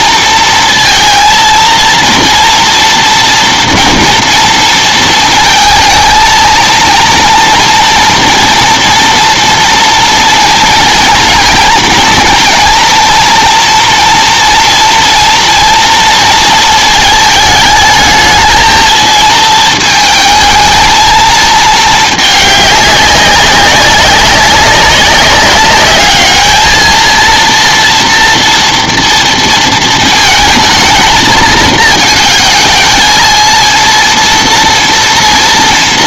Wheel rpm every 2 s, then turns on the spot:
230, 230, 230, 230, 230, 230, 230, 230, 230, 220, 220, 210, 200, 220, 230, 220, 220, 230.
none